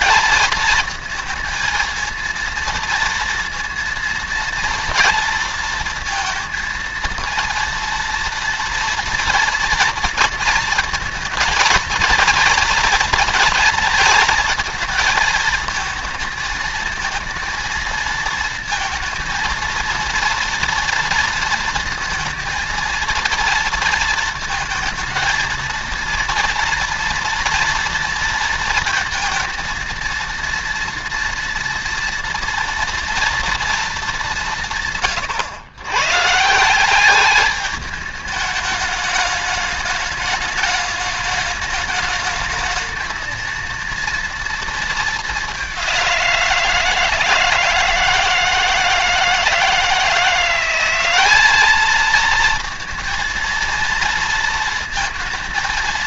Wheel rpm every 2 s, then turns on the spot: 220, 230, 230, 230, 230, 230, 230, 220, 220, 230, 230, 230, 220, 230, 230, 230, 230, 170, 170, 210, 210, 220, 230, 170, 160, 180, 230, 230.
none